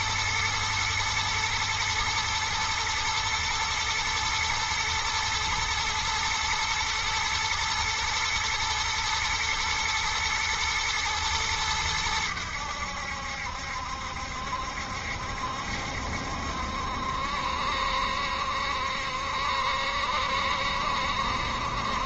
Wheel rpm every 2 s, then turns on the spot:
110, 110, 110, 120, 110, 110, 90, 70, 70, 70, 70.
none